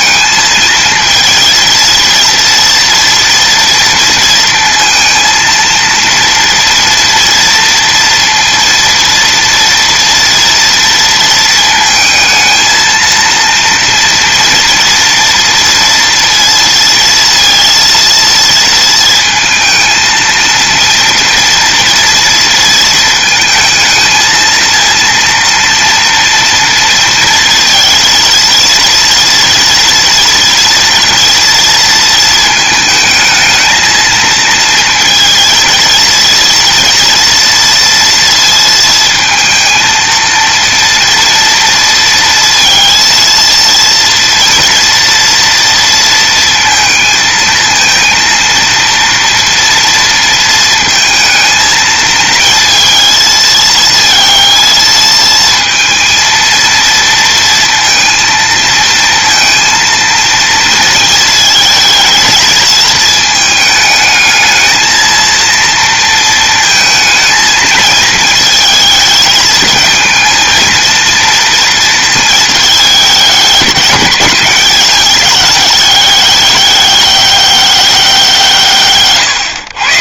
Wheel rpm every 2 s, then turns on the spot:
230, 230, 230, 230, 230, 230, 220, 230, 230, 230, 230, 220, 230, 230, 230, 230, 220, 230, 230, 230, 230, 230, 230, 220, 230, 230, 220, 230, 230, 230, 230, 220, 220, 230, 220, 230, 210, 200, 200, 150.
none